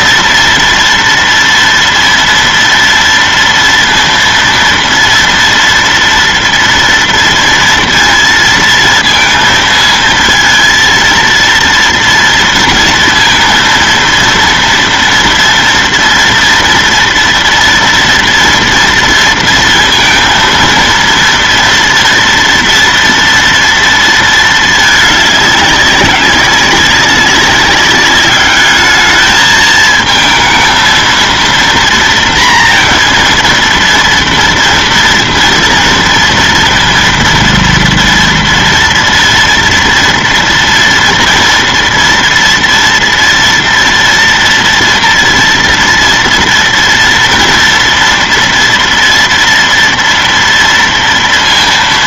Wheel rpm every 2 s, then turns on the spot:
230, 230, 230, 230, 230, 230, 230, 230, 230, 230, 230, 230, 220, 200, 210, 220, 230, 230, 230, 230, 230, 230, 230, 230, 230, 230.
none